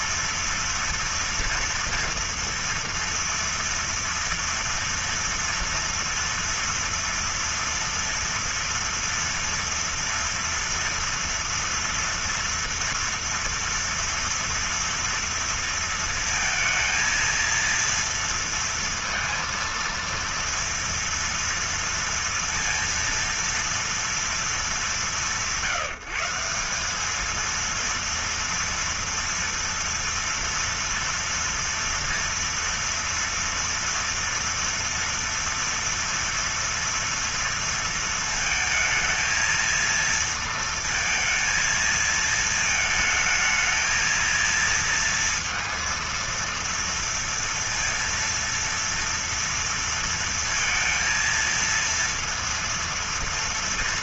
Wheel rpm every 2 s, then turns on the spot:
230, 230, 230, 230, 230, 230, 230, 230, 230, 230, 230, 230, 190, 200, 230, 230, 230, 230, 230, 220, 230, 220, 230, 230, 230, 230, 230.
none